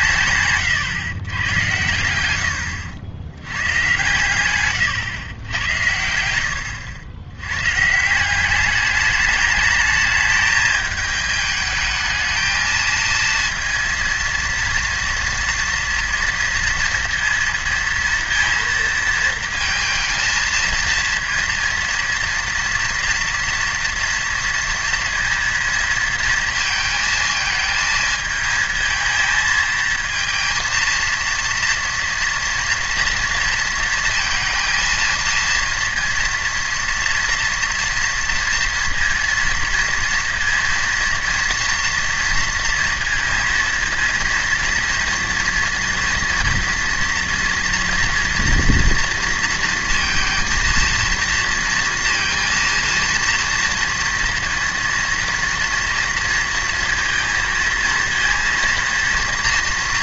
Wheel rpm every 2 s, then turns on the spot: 130, 90, 120, 90, 200, 210, 220, 230, 230, 230, 230, 230, 230, 230, 220, 230, 230, 230, 230, 230, 230, 230, 230, 230, 230, 230, 230, 230, 230, 230.
0-2